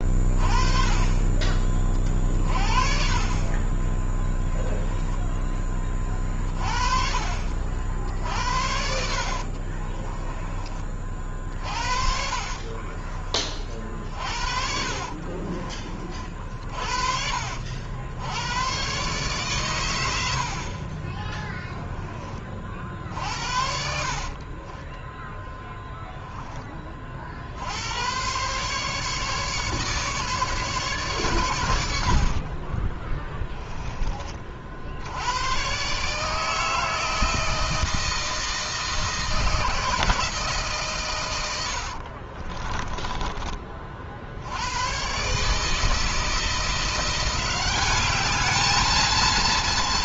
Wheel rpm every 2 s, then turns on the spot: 30, 40, 10, 40, 70, 40, 40, 50, 60, 120, 20, 60, 20, 30, 140, 120, 20, 70, 160, 160, 120, 20, 120, 170, 220.
8-10 12-16 20-22 24-26 32-34 42-44